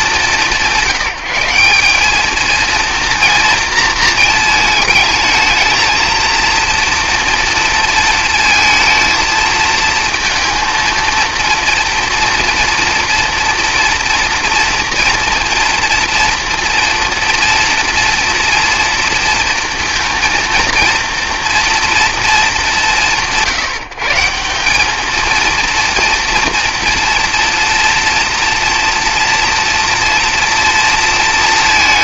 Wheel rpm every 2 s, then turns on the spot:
170, 230, 220, 230, 220, 230, 240, 230, 230, 240, 230, 200, 170, 230, 230, 230.
none